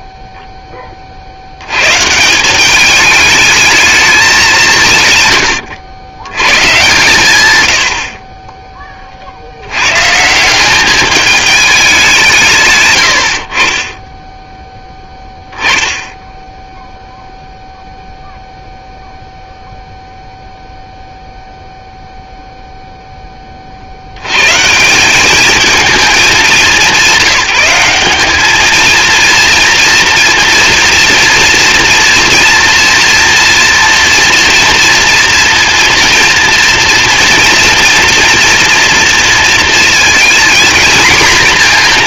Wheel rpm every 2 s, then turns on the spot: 10, 200, 180, 130, 30, 200, 90, 10, 0, 0, 0, 20, 200, 200, 230, 230, 230, 230, 230, 230, 240.
none